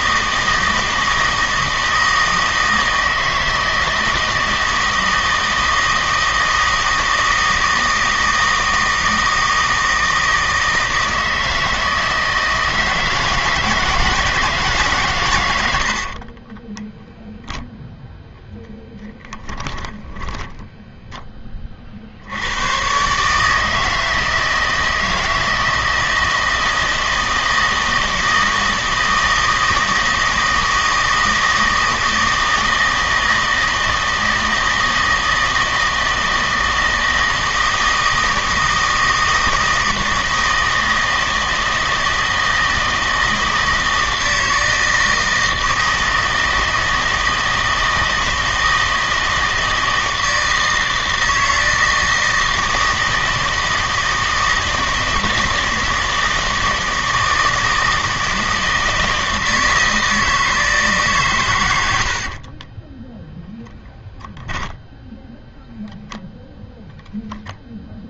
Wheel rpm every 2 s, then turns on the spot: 160, 160, 160, 160, 160, 160, 160, 150, 20, 10, 10, 100, 160, 160, 160, 160, 160, 160, 160, 160, 160, 160, 160, 160, 160, 160, 160, 160, 160, 160, 160, 20, 10, 0.
16-18 20-22 62-66